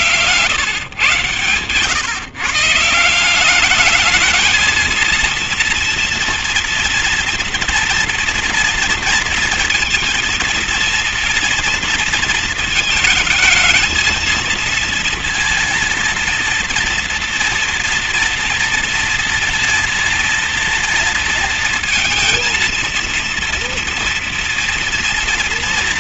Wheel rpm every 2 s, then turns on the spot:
120, 170, 230, 230, 230, 230, 220, 230, 230, 230, 230, 230, 240.
none